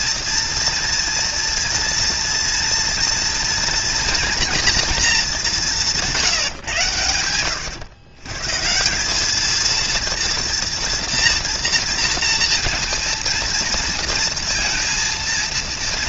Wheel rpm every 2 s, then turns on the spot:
230, 240, 230, 170, 130, 230, 230, 230.
none